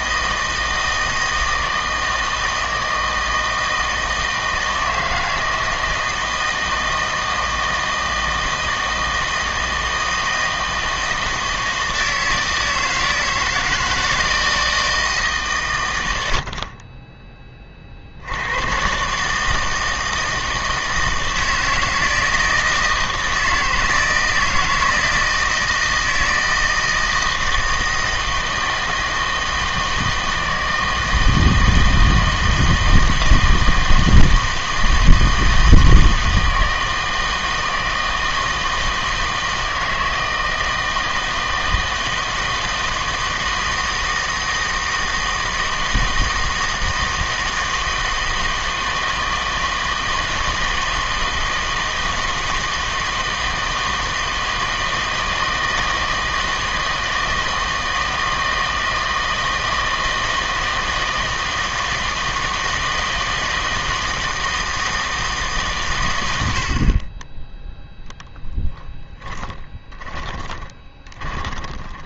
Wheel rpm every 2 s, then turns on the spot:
160, 160, 160, 160, 160, 160, 160, 160, 40, 110, 160, 160, 160, 160, 160, 160, 160, 160, 160, 160, 160, 160, 160, 160, 160, 160, 160, 160, 160, 160, 160, 160, 160, 70, 20, 20.
68-72